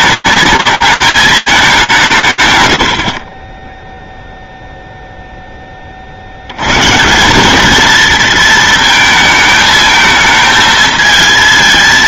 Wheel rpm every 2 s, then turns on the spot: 210, 130, 0, 100, 230, 220.
none